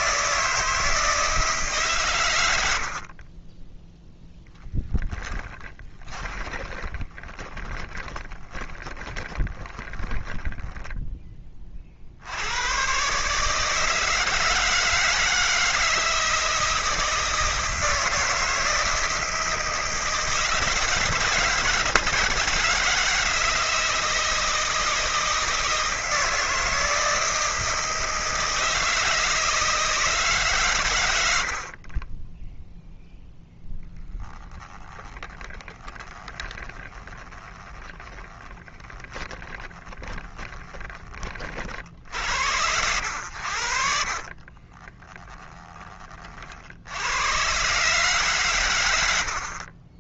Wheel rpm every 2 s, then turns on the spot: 160, 80, 20, 20, 20, 10, 100, 160, 160, 160, 160, 160, 160, 160, 160, 120, 0, 10, 20, 20, 20, 80, 40, 60, 100.
4-12 34-42 44-46